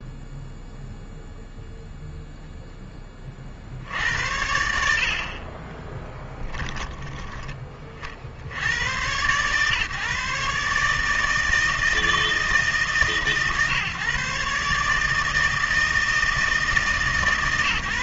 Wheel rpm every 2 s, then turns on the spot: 0, 0, 70, 20, 90, 150, 150, 140, 160.
none